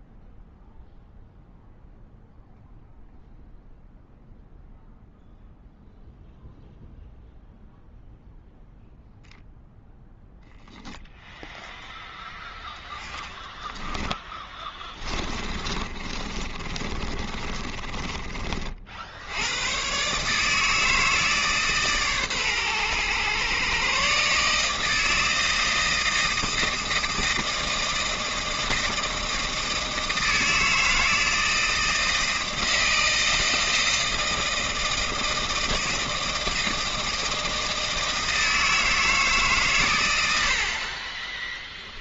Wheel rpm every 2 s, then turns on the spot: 0, 0, 0, 0, 0, 0, 10, 20, 30, 30, 150, 120, 150, 160, 160, 160, 160, 160, 160, 160, 60.
12-18 40-42